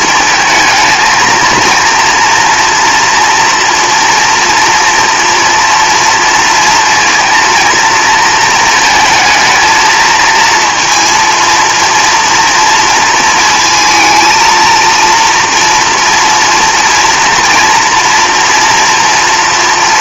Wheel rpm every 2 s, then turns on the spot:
220, 240, 230, 230, 230, 230, 230, 230, 230, 240.
none